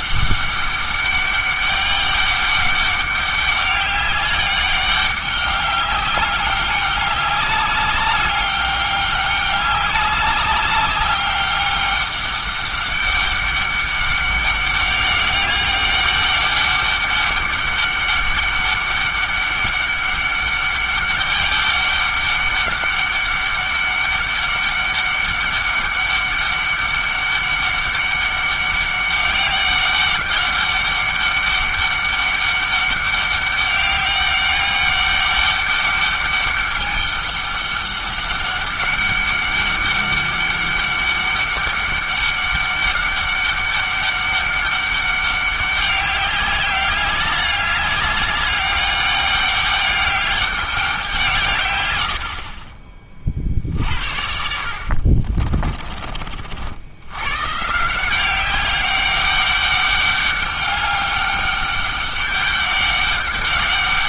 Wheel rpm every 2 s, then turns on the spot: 200, 200, 200, 200, 200, 200, 200, 190, 200, 200, 200, 200, 200, 200, 200, 200, 200, 200, 200, 200, 200, 200, 200, 200, 200, 190, 30, 60, 70, 190, 200, 200.
52-56